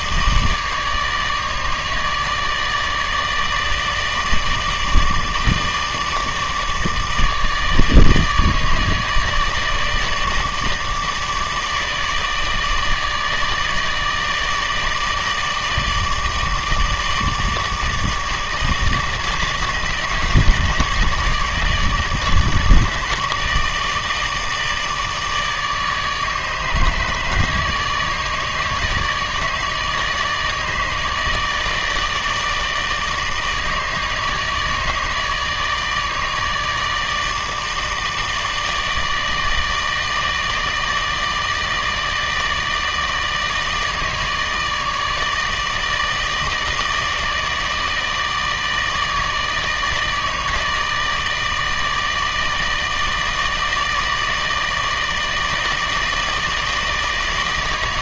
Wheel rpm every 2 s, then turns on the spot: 150, 150, 160, 150, 160, 150, 160, 160, 160, 150, 160, 150, 160, 150, 160, 160, 160, 160, 160, 160, 160, 160, 160, 160, 160, 160, 160, 160, 160.
none